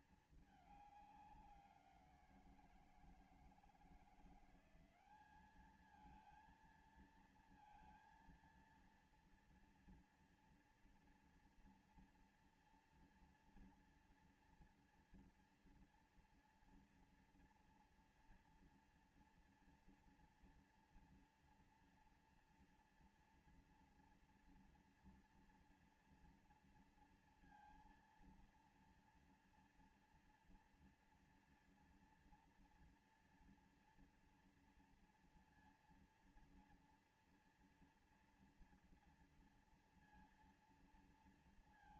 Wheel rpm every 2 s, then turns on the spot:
230, 190, 160, 200, 230, 230, 230, 230, 230, 230, 230, 230, 230, 230, 230, 230, 230, 230, 230, 230, 230.
none